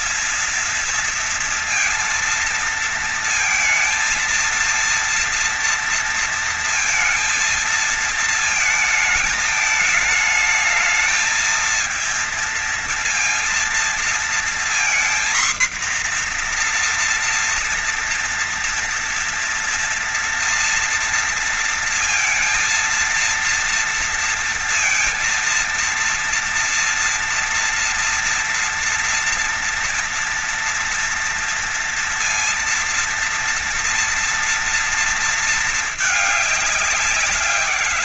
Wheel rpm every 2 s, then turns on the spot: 230, 230, 230, 230, 220, 220, 230, 230, 240, 230, 240, 230, 230, 230, 230, 230, 230, 230, 210.
none